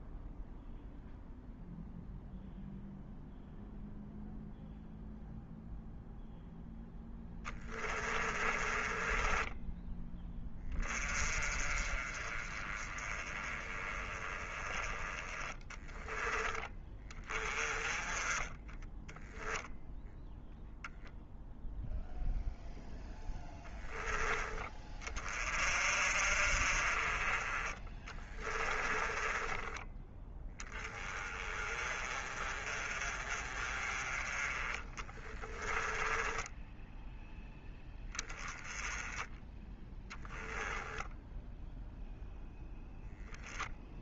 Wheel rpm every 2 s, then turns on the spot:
0, 0, 0, 0, 20, 20, 20, 20, 20, 10, 0, 0, 20, 40, 20, 10, 30, 20, 10, 10, 10, 0.
8-10 28-30 34-38 40-42